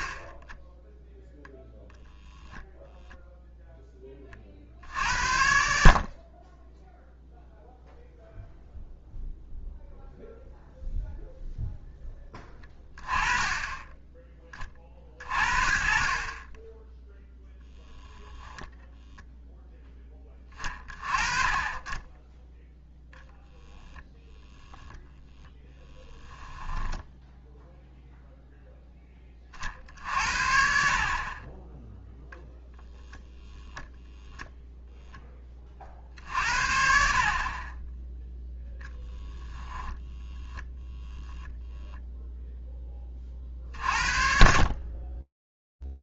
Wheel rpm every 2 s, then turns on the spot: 10, 0, 50, 10, 0, 0, 10, 30, 10, 0, 30, 0, 0, 10, 0, 50, 0, 0, 60, 0, 10, 10, 50.
26-28